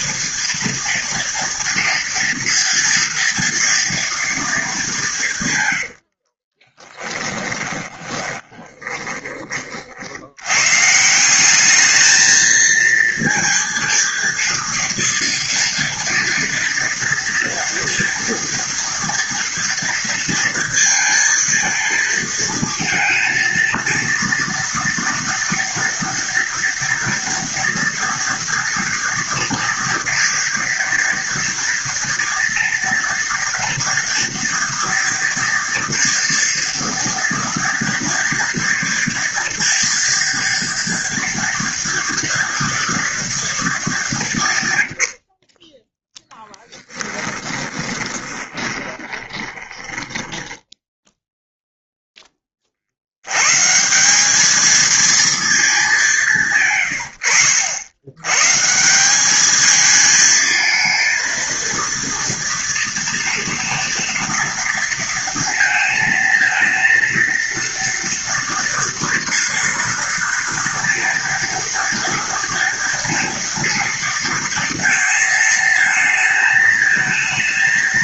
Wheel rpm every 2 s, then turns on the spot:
230, 230, 190, 10, 20, 150, 230, 230, 230, 230, 230, 230, 230, 240, 230, 230, 230, 240, 240, 230, 240, 230, 80, 10, 20, 10, 70, 220, 110, 180, 230, 230, 230, 230, 230, 230, 230, 230, 220.
6-10 46-50